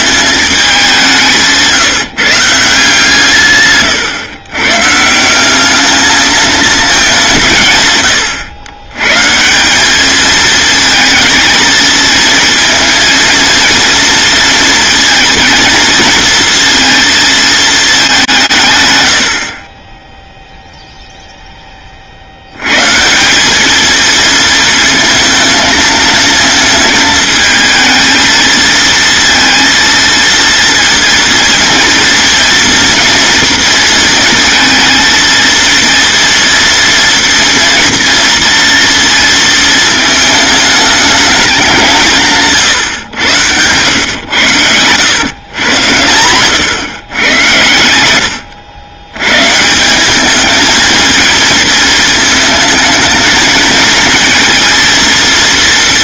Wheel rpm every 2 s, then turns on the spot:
200, 150, 140, 200, 120, 220, 230, 230, 230, 100, 0, 170, 230, 220, 230, 230, 230, 220, 230, 230, 210, 120, 110, 120, 100, 220, 220, 230.
44-46